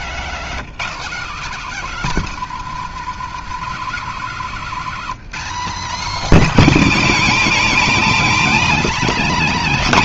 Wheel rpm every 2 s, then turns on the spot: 240, 230, 210, 270, 280.
4-6